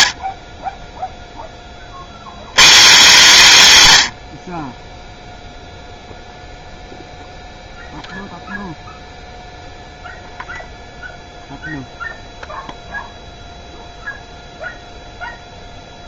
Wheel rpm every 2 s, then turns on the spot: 50, 200, 30, 0, 0, 0, 0, 0.
none